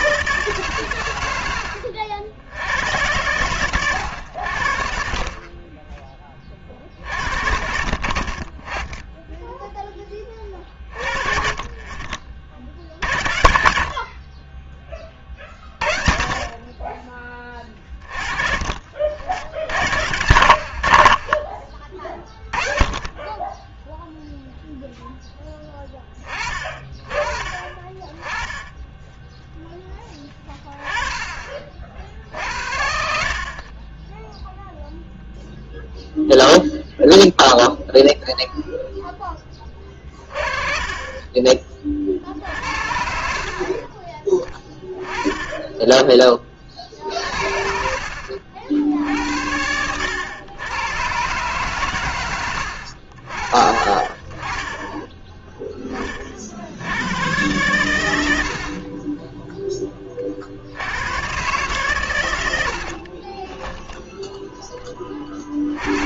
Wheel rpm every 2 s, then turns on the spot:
120, 90, 60, 60, 20, 40, 80, 20, 20, 60, 60, 30, 0, 30, 10, 20, 70, 0, 0, 0, 30, 60, 10, 50, 70, 120, 70, 10, 90, 30, 100, 40, 10.
32-34 46-48 62-64